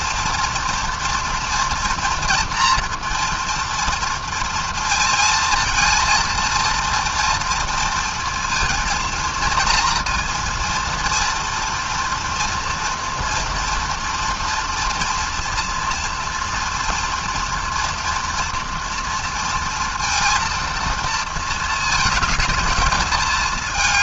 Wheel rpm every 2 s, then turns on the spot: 230, 240, 230, 230, 230, 240, 230, 230, 230, 240, 230, 220.
none